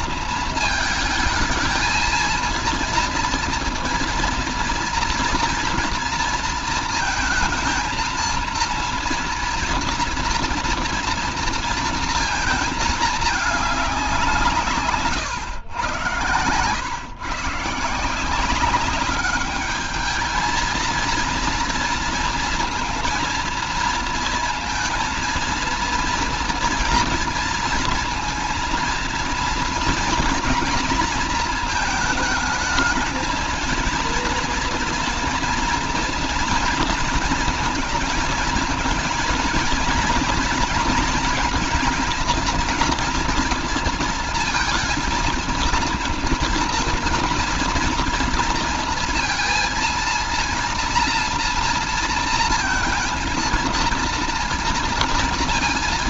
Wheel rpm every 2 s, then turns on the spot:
220, 230, 230, 220, 230, 230, 210, 130, 130, 200, 230, 230, 230, 230, 230, 230, 220, 230, 230, 230, 230, 240, 230, 230, 230, 240, 230, 230.
none